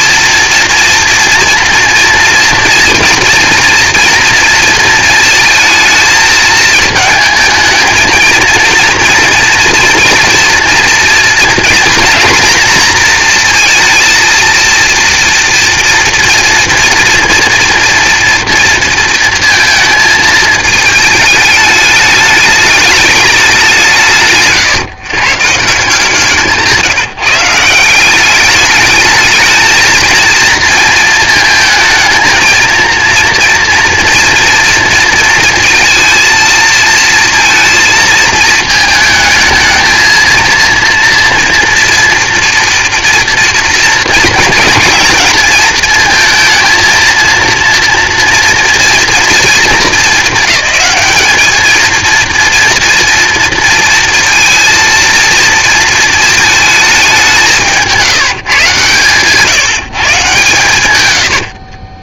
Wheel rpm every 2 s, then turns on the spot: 230, 230, 230, 220, 230, 230, 230, 230, 230, 230, 220, 220, 140, 160, 210, 230, 230, 230, 230, 220, 230, 240, 230, 230, 230, 210, 230, 230, 220, 140, 130.
none